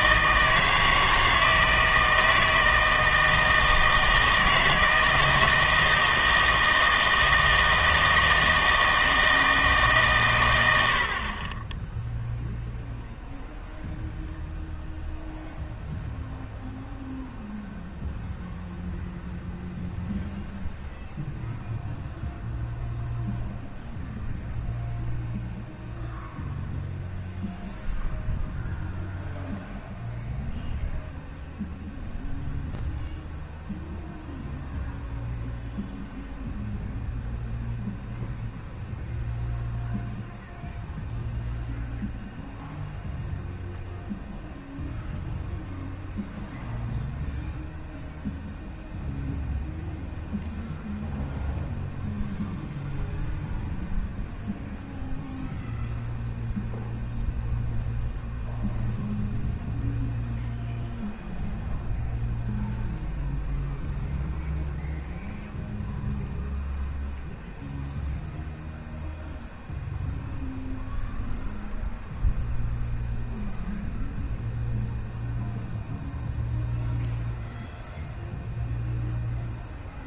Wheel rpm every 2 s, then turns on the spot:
160, 160, 160, 160, 160, 110, 0, 0, 0, 0, 0, 0, 0, 0, 0, 0, 0, 0, 0, 0, 0, 0, 0, 0, 0, 0, 0, 0, 0, 0, 0, 0, 0, 0, 0, 0, 0, 0, 0, 0.
none